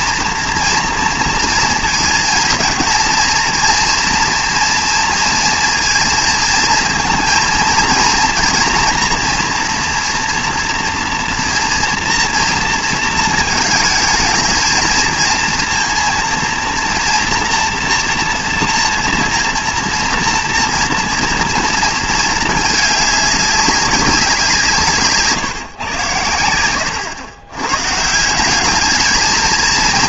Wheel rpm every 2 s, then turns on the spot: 230, 230, 230, 230, 230, 230, 230, 220, 230, 230, 230, 220, 170, 100, 190.
none